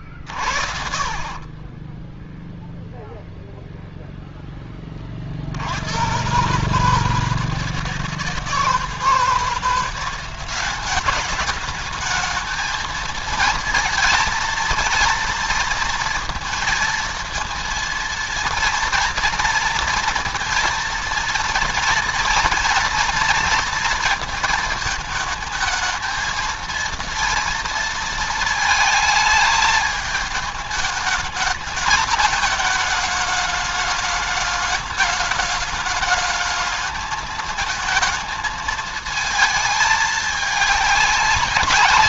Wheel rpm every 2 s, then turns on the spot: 50, 0, 10, 140, 160, 190, 220, 230, 230, 230, 230, 240, 230, 230, 220, 210, 220, 210, 220, 220, 200.
none